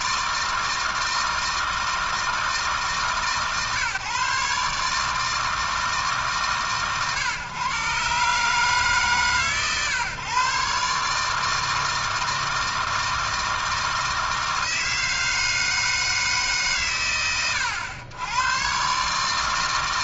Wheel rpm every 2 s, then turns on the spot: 160, 150, 150, 120, 140, 150, 160, 160, 110, 140.
none